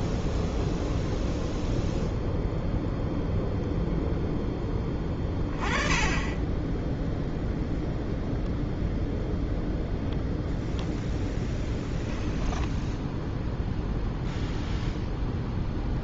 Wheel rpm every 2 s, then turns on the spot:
0, 0, 10, 10, 0, 0, 10, 0.
none